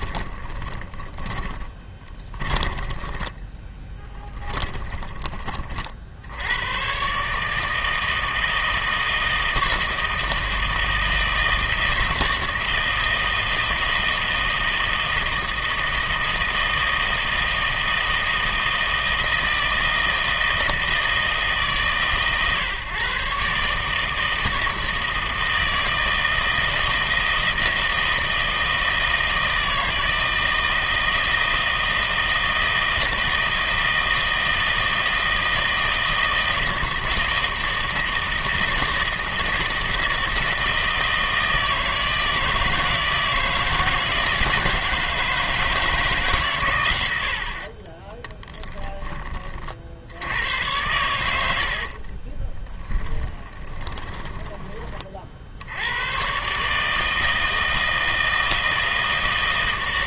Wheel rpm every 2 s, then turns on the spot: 20, 10, 20, 110, 160, 160, 160, 160, 160, 160, 160, 130, 160, 160, 160, 160, 160, 160, 160, 160, 160, 160, 170, 110, 20, 100, 10, 20, 150, 160.
0-6 48-50 52-54